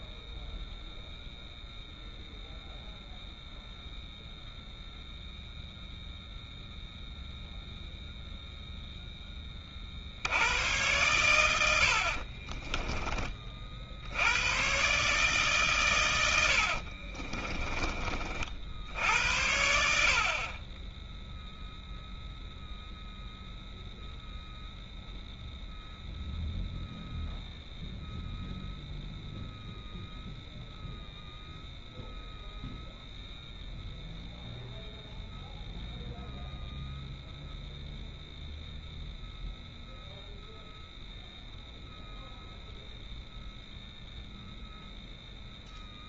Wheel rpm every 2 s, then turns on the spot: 0, 0, 0, 0, 0, 80, 30, 110, 60, 60, 20, 0, 0, 0, 0, 0, 0, 0, 0, 0, 0, 0, 0.
12-14 16-18